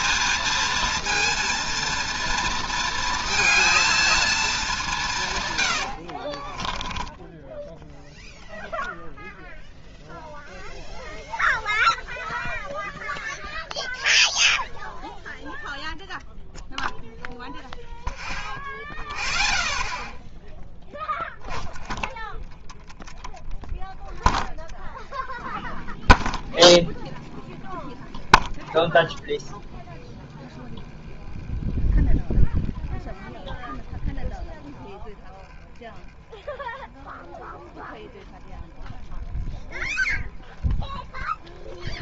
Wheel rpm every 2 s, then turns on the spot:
230, 230, 190, 30, 0, 0, 0, 0, 0, 0, 0, 10, 10, 10, 10, 10, 10, 10, 10, 10, 10.
6-8